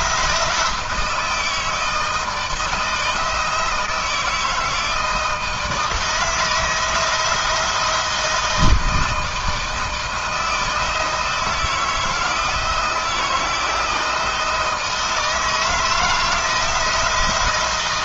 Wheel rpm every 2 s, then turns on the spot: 170, 170, 160, 160, 160, 160, 160, 160, 160.
none